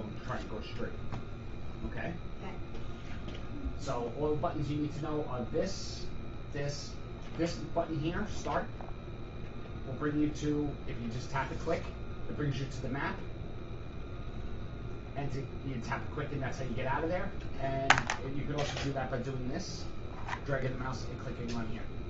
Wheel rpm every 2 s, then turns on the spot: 0, 0, 0, 0, 0, 0, 0, 0, 0, 0, 0.
none